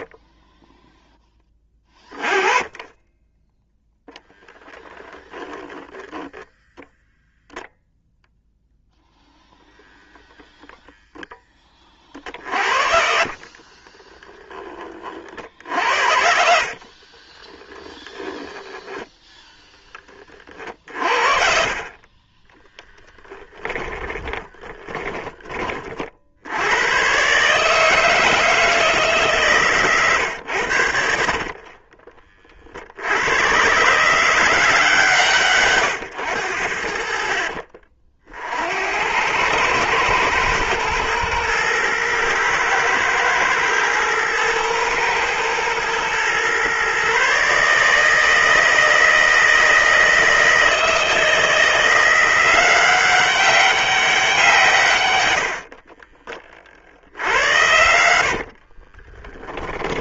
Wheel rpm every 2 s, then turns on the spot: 0, 20, 0, 0, 0, 0, 50, 30, 40, 10, 40, 10, 20, 100, 160, 80, 50, 160, 70, 70, 110, 110, 120, 130, 160, 160, 190, 130, 50, 40.
12-14 16-18 22-26 58-60